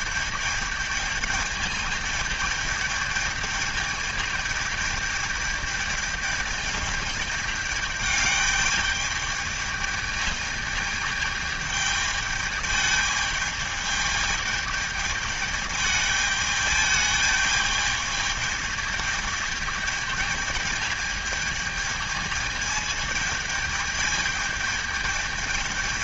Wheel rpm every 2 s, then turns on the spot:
210, 210, 210, 210, 210, 210, 220, 220, 210, 220, 220, 210, 210.
none